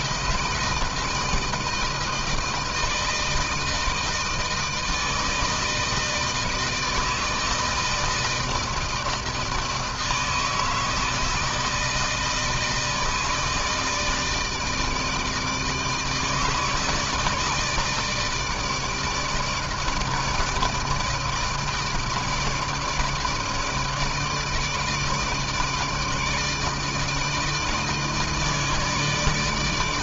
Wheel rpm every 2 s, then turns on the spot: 160, 160, 160, 160, 160, 160, 160, 160, 160, 160, 160, 160, 160, 160, 150.
none